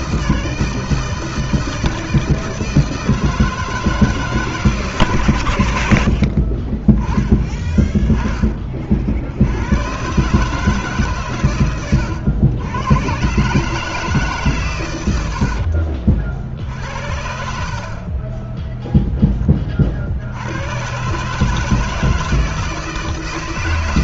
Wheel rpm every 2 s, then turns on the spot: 160, 160, 130, 20, 50, 140, 100, 110, 60, 10, 120, 160.
6-8